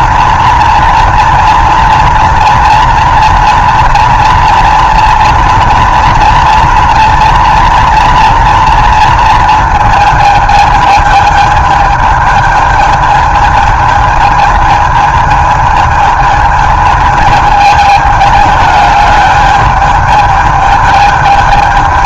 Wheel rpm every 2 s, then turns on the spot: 230, 230, 230, 230, 230, 220, 220, 220, 220, 210, 210.
none